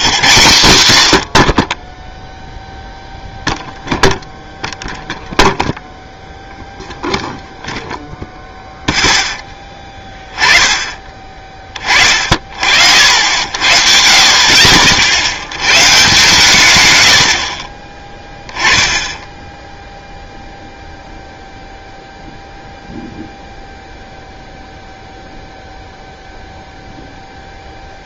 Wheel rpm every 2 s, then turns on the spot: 140, 0, 0, 0, 0, 20, 60, 40, 120, 10, 0, 0, 0, 0.
none